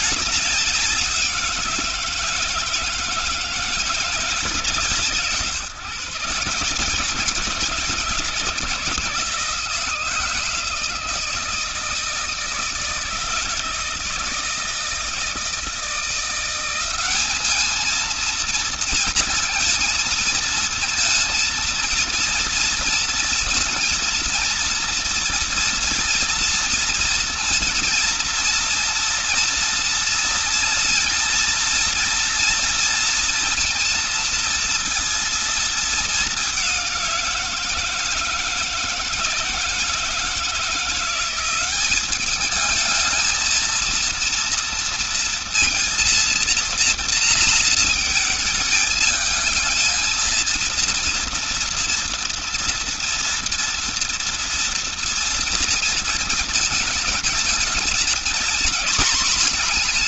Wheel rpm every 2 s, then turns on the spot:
190, 170, 160, 140, 150, 160, 160, 160, 180, 230, 230, 230, 230, 230, 230, 230, 230, 230, 200, 160, 160, 210, 230, 230, 220, 230, 230, 230, 220, 230.
none